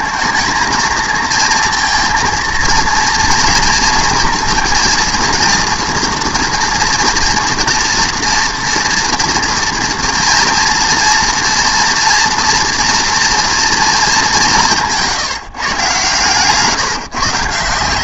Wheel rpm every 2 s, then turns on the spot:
220, 230, 230, 240, 230, 230, 240, 180, 140.
none